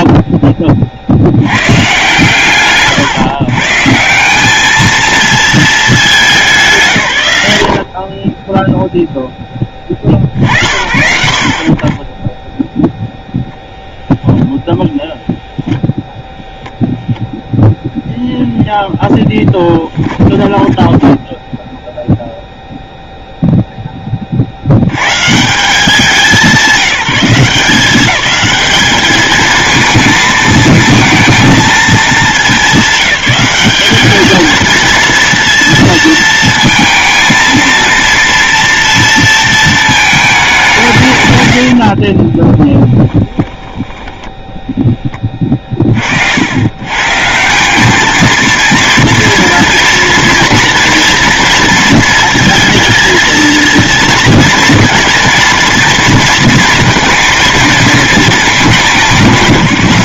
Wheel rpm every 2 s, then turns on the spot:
50, 140, 220, 120, 0, 70, 0, 0, 0, 0, 10, 0, 100, 190, 210, 220, 210, 230, 230, 230, 170, 10, 0, 130, 230, 230, 230, 230, 230, 190.
20-22 42-44